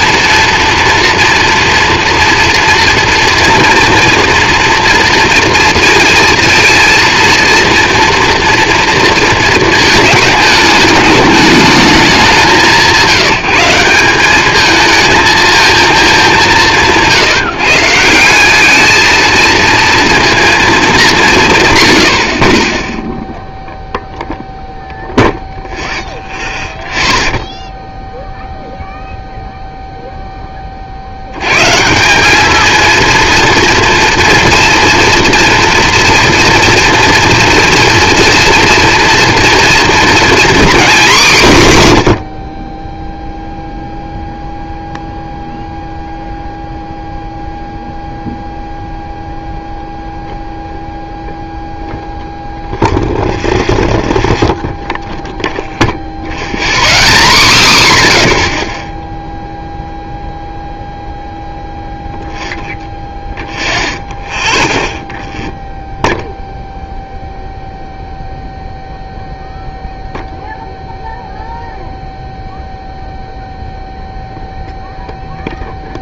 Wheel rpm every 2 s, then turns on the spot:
230, 230, 230, 230, 230, 210, 190, 210, 180, 210, 220, 30, 0, 0, 0, 30, 230, 230, 240, 230, 250, 40, 0, 0, 0, 0, 0, 0, 0, 0, 0, 0, 0, 0, 0, 0, 0, 0.
none